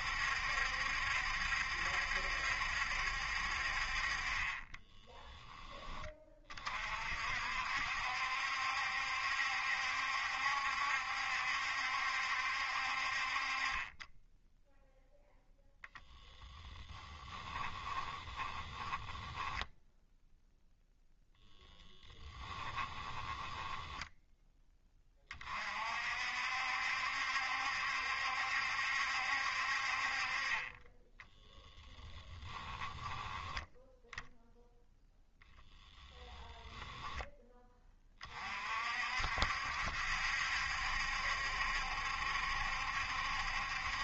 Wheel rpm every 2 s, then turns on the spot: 70, 70, 10, 40, 70, 70, 60, 0, 10, 20, 0, 10, 20, 60, 70, 20, 10, 0, 10, 50, 70, 70.
4-6 16-20 22-24